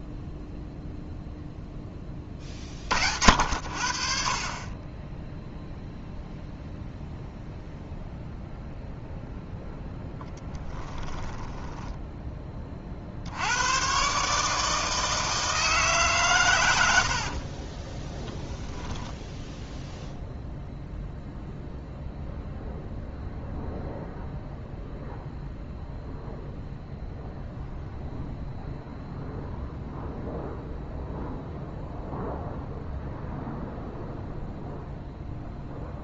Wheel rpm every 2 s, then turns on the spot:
0, 50, 30, 0, 0, 10, 40, 160, 100, 0, 0, 0, 0, 0, 0, 0, 0, 0.
10-12